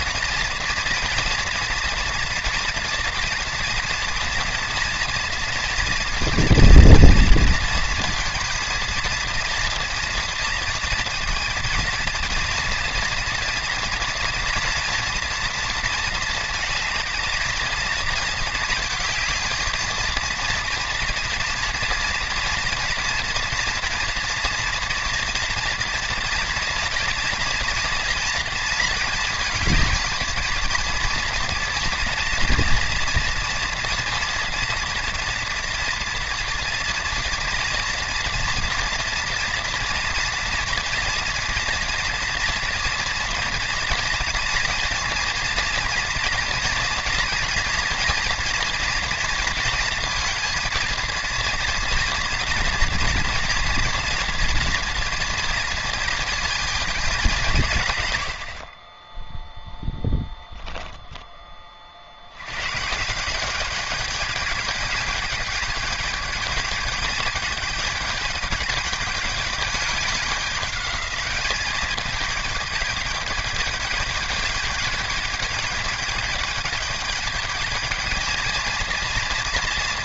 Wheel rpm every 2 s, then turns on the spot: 230, 240, 230, 230, 230, 230, 230, 240, 230, 220, 230, 230, 230, 230, 220, 230, 230, 230, 240, 230, 230, 230, 230, 230, 240, 230, 230, 230, 220, 30, 0, 140, 210, 210, 210, 210, 210, 210, 210, 230.
none